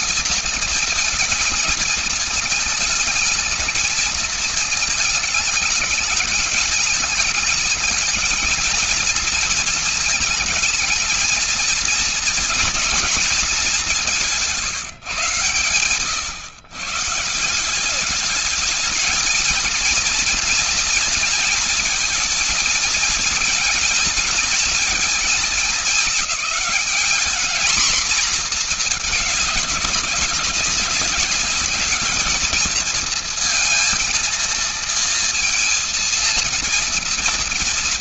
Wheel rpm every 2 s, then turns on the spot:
220, 220, 220, 220, 230, 220, 220, 140, 160, 220, 230, 230, 220, 220, 210, 200, 230, 230, 230.
none